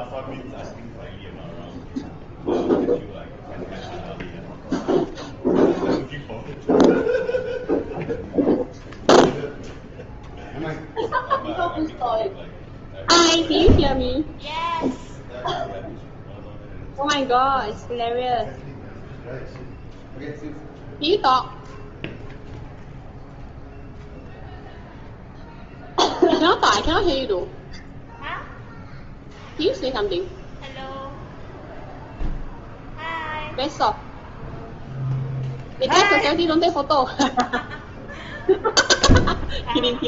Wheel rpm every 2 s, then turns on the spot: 0, 0, 0, 0, 0, 0, 0, 0, 0, 0, 0, 0, 0, 0, 0, 0, 0, 0, 0, 0.
none